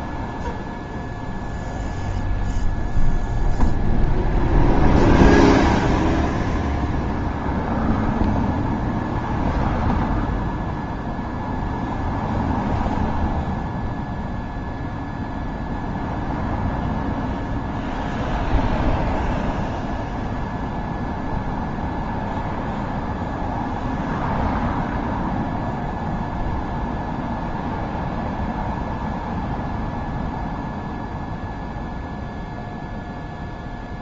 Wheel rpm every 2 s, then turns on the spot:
0, 0, 0, 0, 0, 0, 0, 0, 0, 0, 0, 0, 0, 0, 0, 0, 0.
none